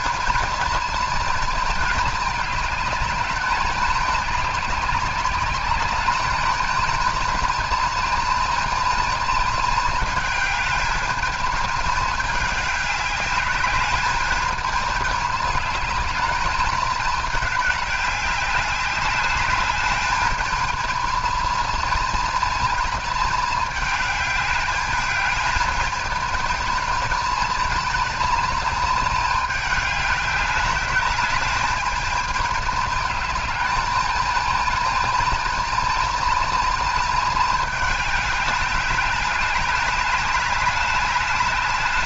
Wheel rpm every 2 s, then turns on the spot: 230, 210, 200, 220, 220, 220, 210, 220, 210, 200, 220, 220, 210, 230, 220, 210, 210, 220, 220, 200, 200.
none